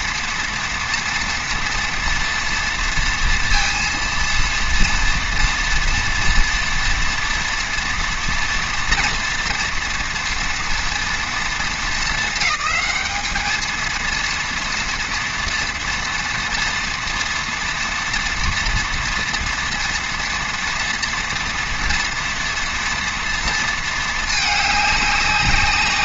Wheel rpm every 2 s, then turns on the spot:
230, 230, 230, 230, 240, 230, 220, 230, 240, 230, 230, 230, 210.
none